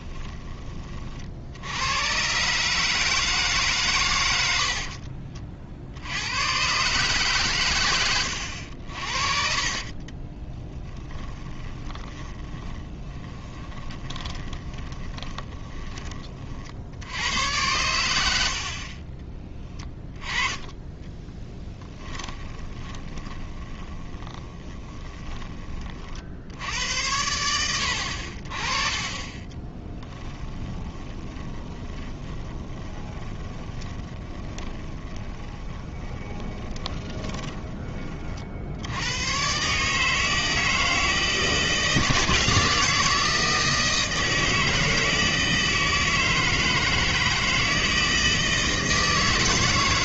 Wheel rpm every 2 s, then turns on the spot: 30, 150, 60, 130, 70, 20, 20, 30, 70, 40, 20, 20, 10, 90, 30, 10, 20, 10, 20, 80, 160, 160, 160, 160, 160.
4-6 10-16 18-20 22-26 28-38